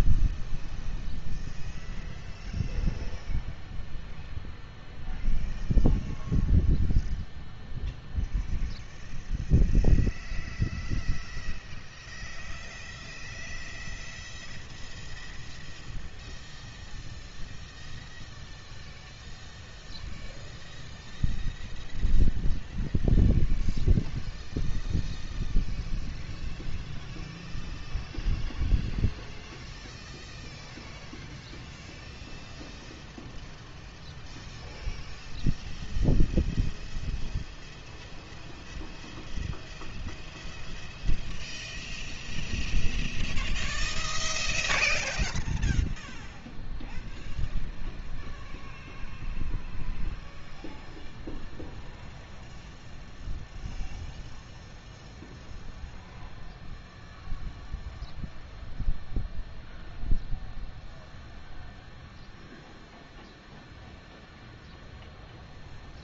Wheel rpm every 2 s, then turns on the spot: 0, 0, 0, 0, 0, 0, 0, 0, 0, 0, 0, 0, 0, 0, 0, 0, 0, 0, 0, 0, 0, 0, 0, 0, 0, 0, 0, 0, 0, 0, 0, 0, 0.
none